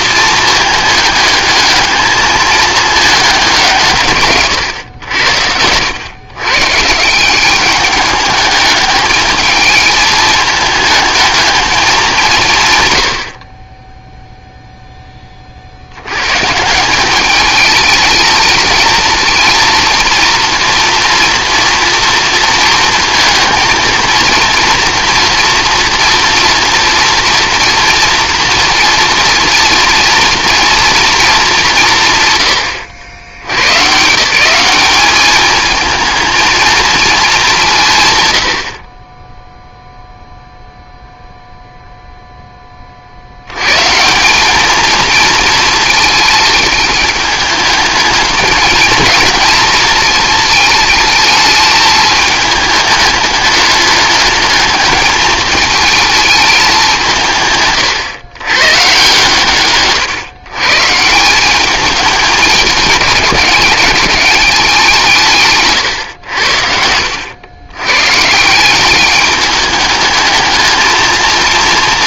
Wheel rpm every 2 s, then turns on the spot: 220, 210, 120, 140, 210, 220, 130, 0, 160, 220, 240, 230, 230, 240, 230, 230, 120, 200, 230, 60, 0, 20, 210, 210, 220, 220, 210, 210, 200, 130, 140, 200, 190, 80, 180, 220.
66-68